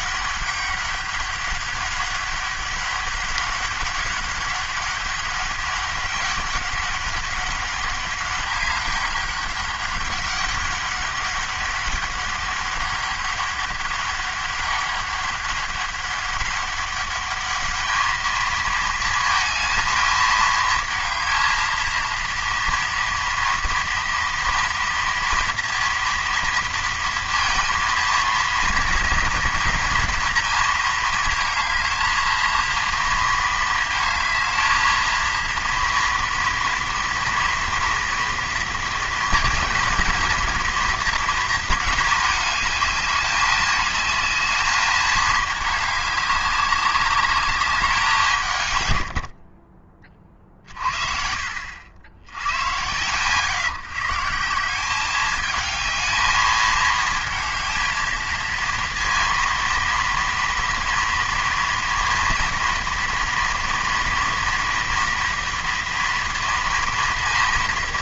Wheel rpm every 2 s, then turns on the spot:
200, 200, 200, 200, 200, 200, 200, 200, 200, 220, 220, 230, 230, 230, 230, 230, 230, 220, 230, 230, 230, 220, 210, 200, 150, 40, 100, 180, 220, 230, 230, 230, 240, 230.
none